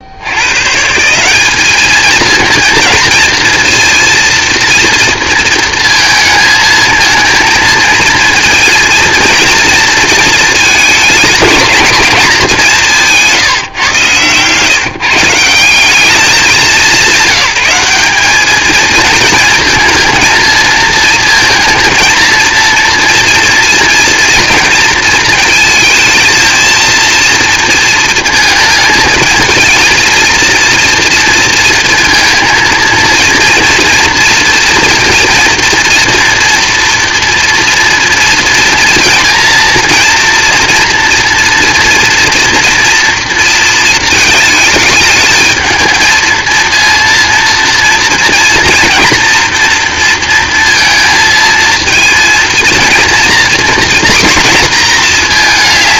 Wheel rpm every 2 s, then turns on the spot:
170, 230, 230, 220, 230, 220, 180, 150, 190, 230, 220, 230, 230, 230, 230, 230, 230, 230, 240, 230, 230, 230, 210, 230, 230, 230, 230, 220.
none